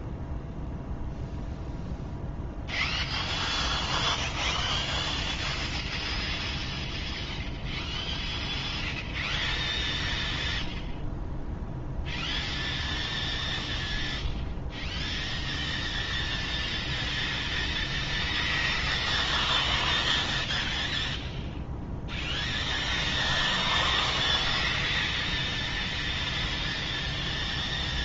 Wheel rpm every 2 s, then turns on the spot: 0, 0, 0, 0, 0, 0, 0, 0, 0, 0, 0, 0, 0, 0.
none